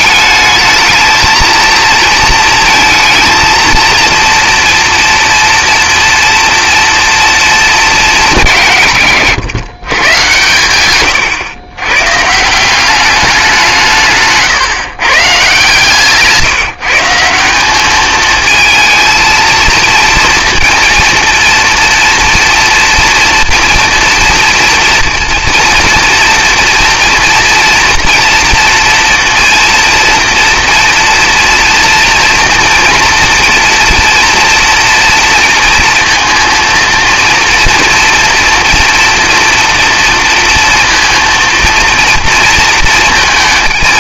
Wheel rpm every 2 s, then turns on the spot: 220, 230, 230, 240, 120, 120, 190, 150, 160, 220, 230, 230, 230, 240, 240, 230, 230, 230, 230, 230, 230, 230.
none